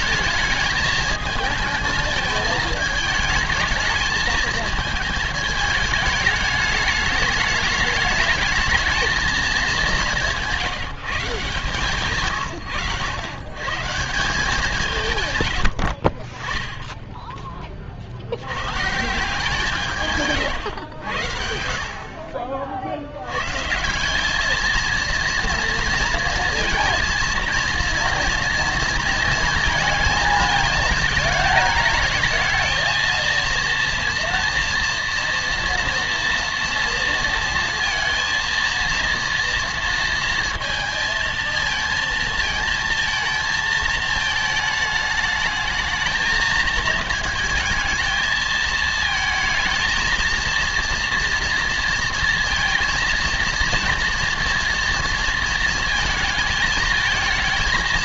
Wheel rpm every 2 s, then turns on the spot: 220, 220, 220, 210, 220, 170, 90, 170, 10, 110, 130, 40, 210, 230, 230, 220, 220, 230, 230, 230, 230, 220, 220, 220, 220, 230, 230, 230, 220.
none